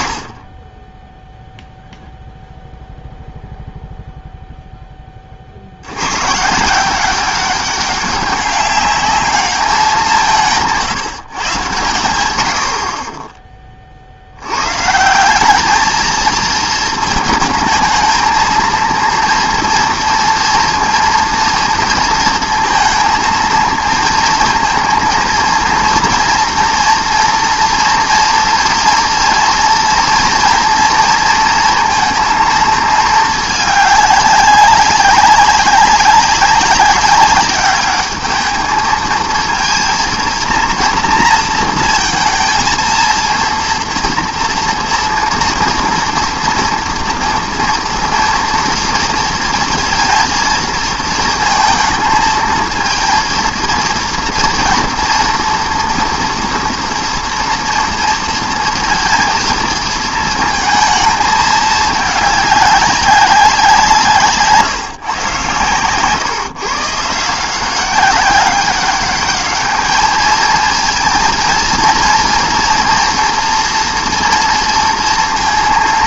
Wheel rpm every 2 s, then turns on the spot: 0, 0, 120, 200, 180, 100, 70, 220, 220, 240, 230, 230, 230, 230, 240, 230, 200, 200, 210, 230, 230, 230, 230, 230, 230, 220, 230, 240, 230, 220, 210, 150, 130, 190, 210, 230, 240, 230.
none